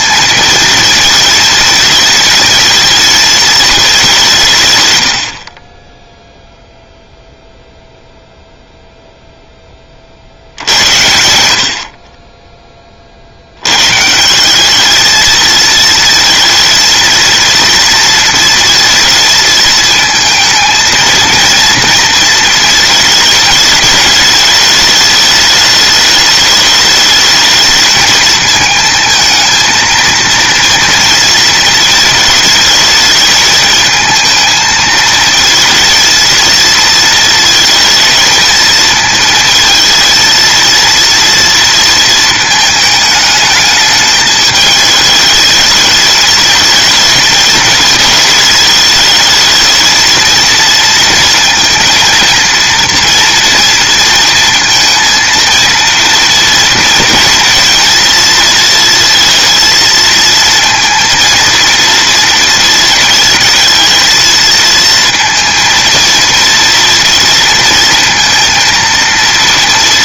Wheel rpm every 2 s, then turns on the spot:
220, 220, 130, 0, 0, 80, 30, 210, 230, 220, 220, 220, 210, 210, 220, 230, 210, 220, 230, 220, 230, 220, 220, 220, 210, 230, 230, 230, 230, 230, 230, 230, 230, 230, 230.
none